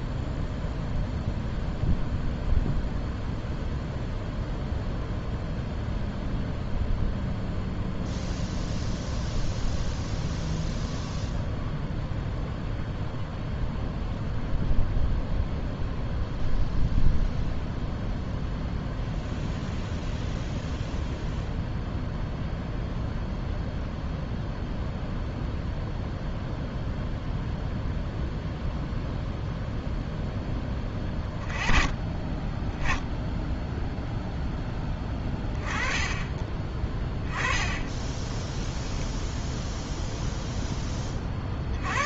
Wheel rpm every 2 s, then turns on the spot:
0, 0, 0, 0, 0, 0, 0, 0, 0, 0, 0, 0, 0, 0, 0, 10, 10, 10, 10, 0, 0.
none